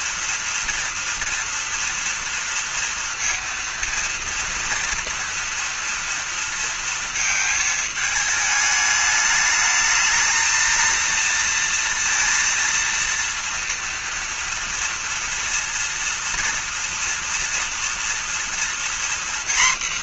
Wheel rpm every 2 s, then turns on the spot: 230, 230, 230, 230, 210, 230, 230, 230, 230, 240.
none